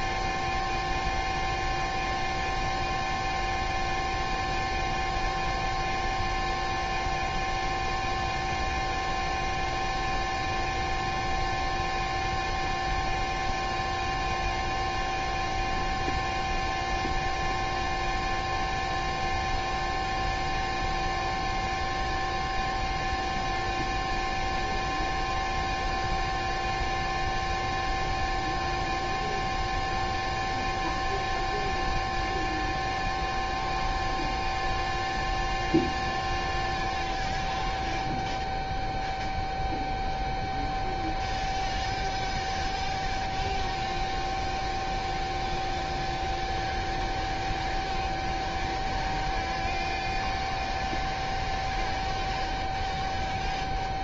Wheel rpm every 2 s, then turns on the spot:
0, 0, 0, 0, 0, 0, 0, 0, 0, 0, 0, 0, 0, 0, 0, 0, 0, 0, 0, 0, 0, 0, 0, 0, 0, 0, 0.
none